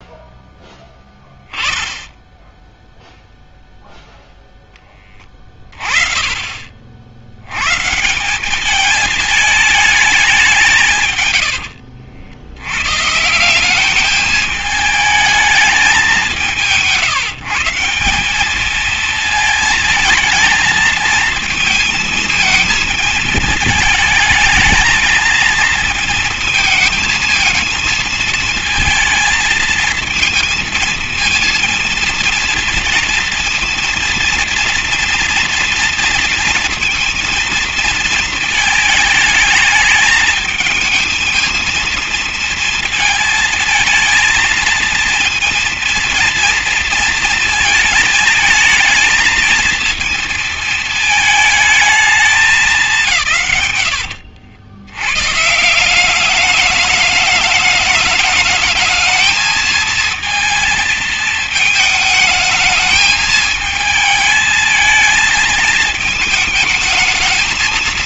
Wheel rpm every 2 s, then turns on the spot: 0, 0, 0, 30, 180, 190, 80, 210, 190, 200, 220, 220, 220, 230, 230, 230, 230, 230, 230, 220, 220, 230, 230, 230, 220, 230, 190, 80, 200, 220, 220, 220, 220, 220.
none